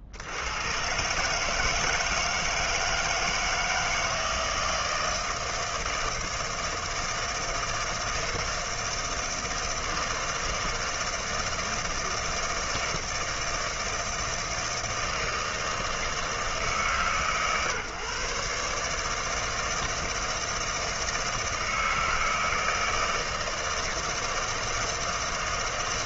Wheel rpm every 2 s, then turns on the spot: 70, 160, 160, 160, 160, 160, 160, 160, 160, 140, 160, 160, 160.
none